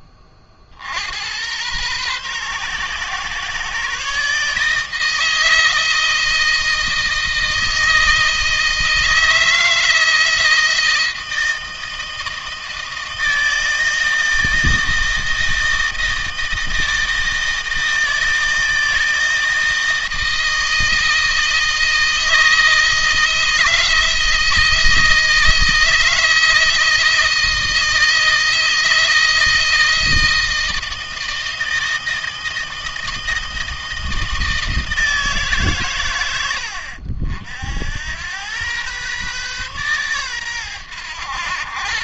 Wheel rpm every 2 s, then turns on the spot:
70, 130, 160, 160, 160, 160, 160, 160, 160, 160, 160, 160, 160, 160, 160, 160, 160, 160, 80, 120, 110.
none